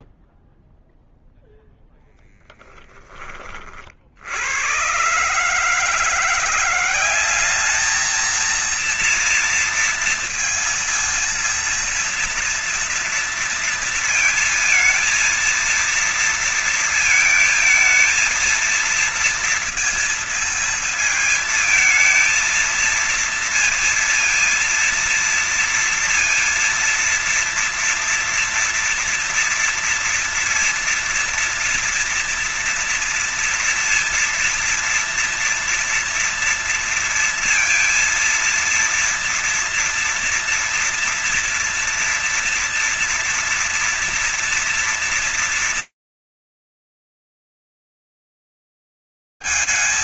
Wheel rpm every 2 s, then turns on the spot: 0, 0, 60, 170, 230, 230, 230, 230, 230, 220, 230, 230, 230, 230, 230, 230, 230, 230, 230, 230, 240, 230, 230, 230, 230.
none